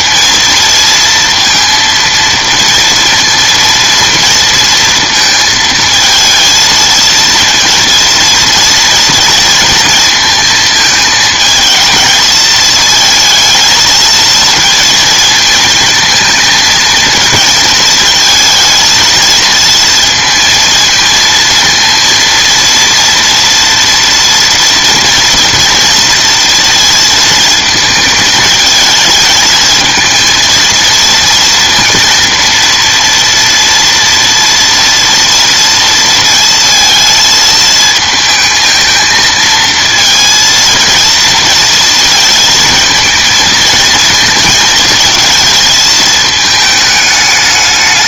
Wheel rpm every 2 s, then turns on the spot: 230, 230, 230, 230, 230, 220, 220, 230, 230, 220, 230, 230, 230, 230, 220, 230, 230, 230, 230, 220, 230, 220, 220, 220.
none